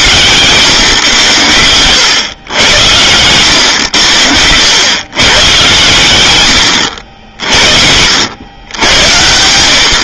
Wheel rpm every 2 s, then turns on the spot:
120, 100, 110, 70, 90.
none